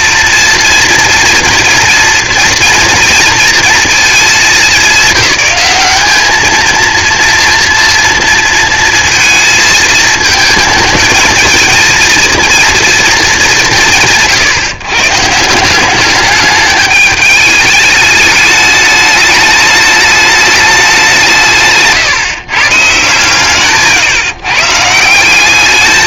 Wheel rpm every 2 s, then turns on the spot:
230, 230, 210, 220, 230, 220, 230, 140, 210, 210, 210, 140, 140.
none